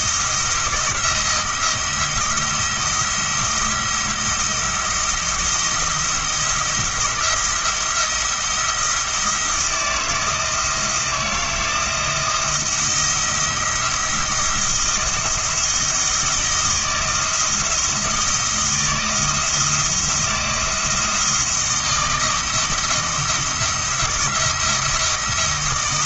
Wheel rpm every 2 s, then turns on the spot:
170, 170, 170, 170, 170, 160, 170, 170, 160, 170, 170, 170, 170.
none